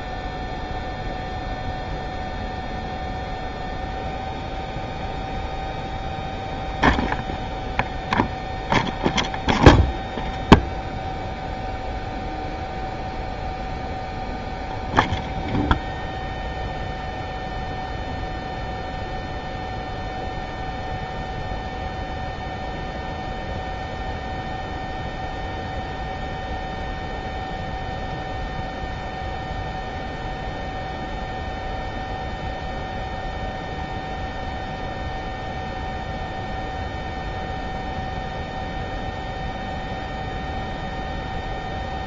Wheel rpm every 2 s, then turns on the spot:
0, 0, 0, 0, 0, 0, 0, 0, 0, 0, 0, 0, 0, 0, 0, 0, 0, 0, 0, 0, 0.
none